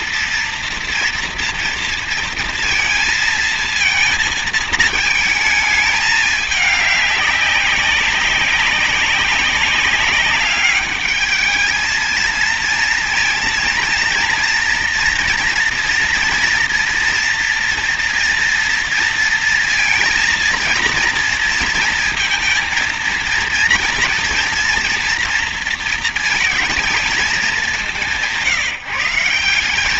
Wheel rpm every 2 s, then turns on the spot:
240, 230, 220, 200, 190, 210, 230, 240, 230, 230, 230, 230, 240, 220, 160.
none